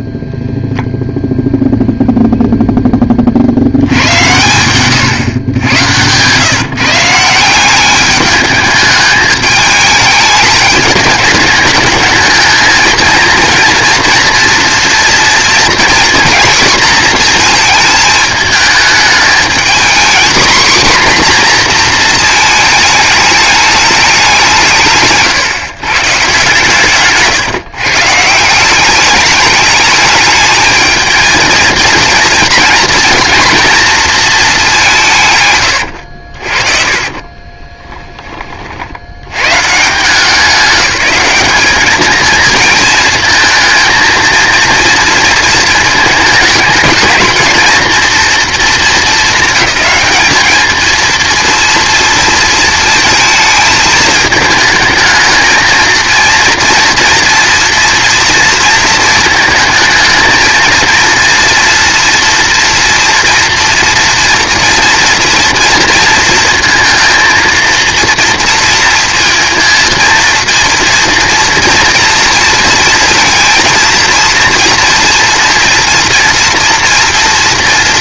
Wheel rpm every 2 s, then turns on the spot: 0, 10, 120, 160, 210, 210, 220, 230, 230, 210, 250, 220, 160, 150, 180, 220, 220, 200, 40, 50, 180, 220, 230, 220, 230, 220, 230, 220, 230, 230, 230, 240, 230, 230, 230, 230, 230, 230, 230.
36-38